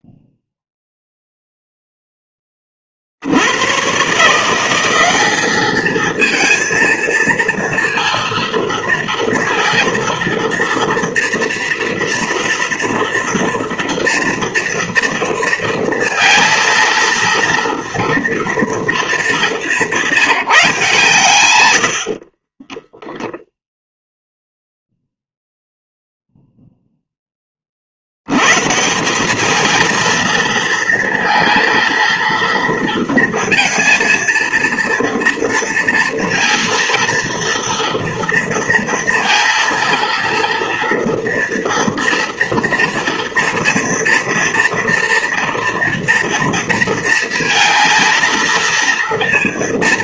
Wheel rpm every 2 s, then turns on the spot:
0, 20, 170, 230, 230, 230, 230, 230, 230, 230, 170, 30, 0, 0, 130, 230, 230, 230, 230, 230, 230, 240, 240, 230, 230.
22-24